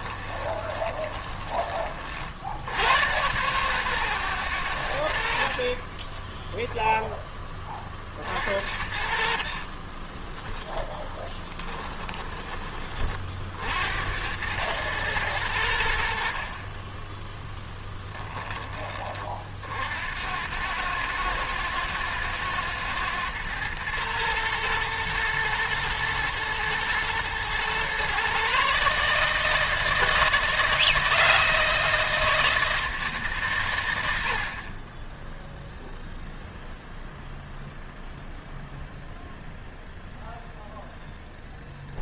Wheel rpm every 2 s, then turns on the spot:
20, 80, 110, 10, 50, 10, 20, 100, 40, 20, 100, 110, 110, 110, 130, 160, 160, 50, 0, 0, 0.
0-2 6-8 10-12